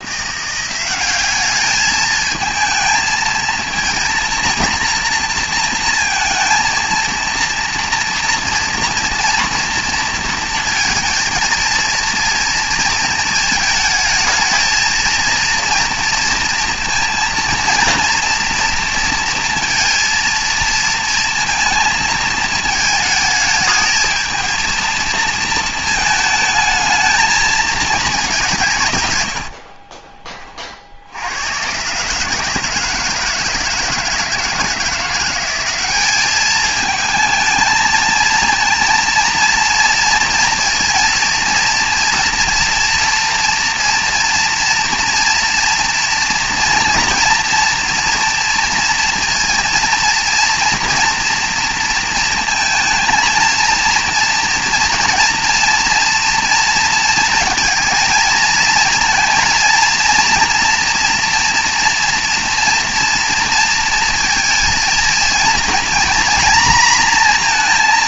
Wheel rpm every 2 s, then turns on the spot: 190, 220, 230, 230, 230, 230, 230, 230, 230, 230, 230, 220, 230, 220, 160, 40, 160, 170, 220, 230, 230, 230, 230, 230, 230, 230, 220, 230, 230, 230, 240, 230, 230, 240.
none